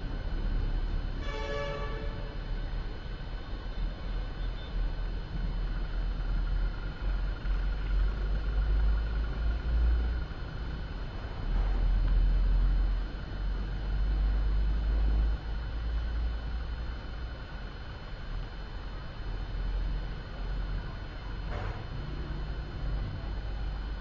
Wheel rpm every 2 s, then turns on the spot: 0, 0, 0, 0, 0, 0, 0, 0, 0, 0, 0, 0.
none